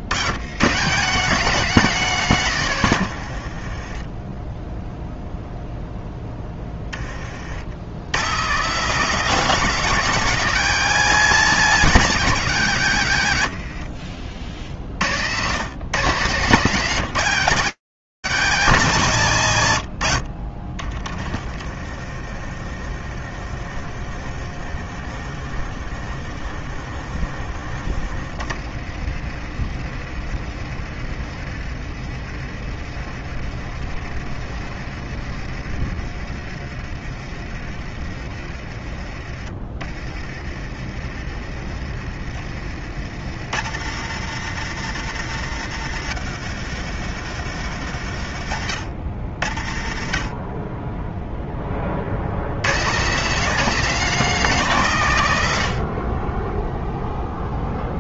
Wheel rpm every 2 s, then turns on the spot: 120, 160, 0, 10, 160, 210, 170, 100, 180, 120, 30, 40, 50, 40, 40, 40, 40, 40, 40, 30, 30, 70, 120, 100, 50, 10, 170, 100, 70.
20-40